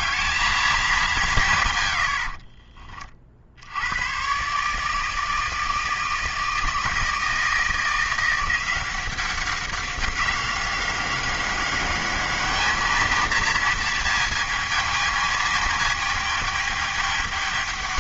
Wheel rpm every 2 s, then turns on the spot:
220, 50, 150, 160, 180, 190, 210, 220, 210.
2-4